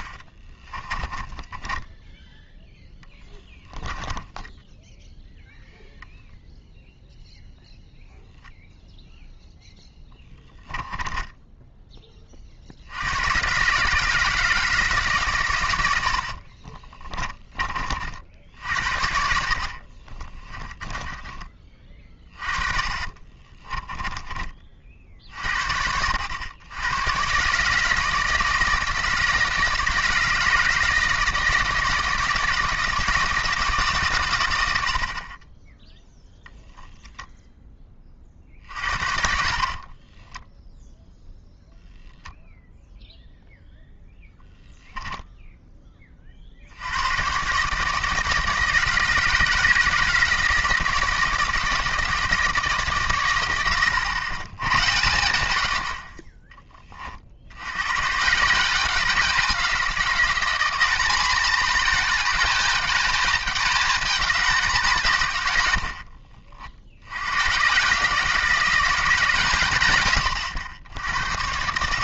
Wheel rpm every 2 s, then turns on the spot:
20, 10, 0, 0, 0, 10, 70, 160, 40, 70, 20, 30, 20, 110, 160, 160, 160, 80, 0, 50, 0, 0, 0, 70, 160, 160, 150, 140, 30, 180, 190, 220, 190, 80, 180, 90.
0-2 16-24 38-40